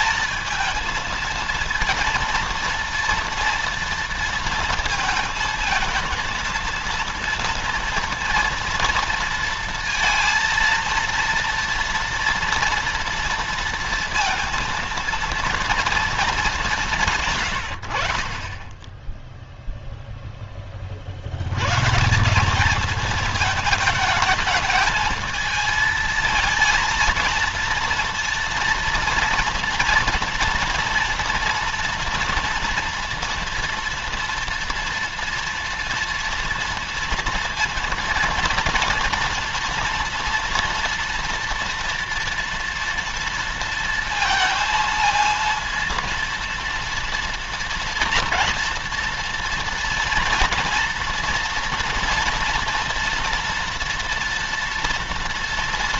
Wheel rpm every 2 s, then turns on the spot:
230, 230, 230, 230, 230, 230, 230, 230, 180, 10, 40, 220, 220, 230, 240, 240, 230, 230, 230, 230, 230, 230, 230, 230, 230, 230, 230, 230.
none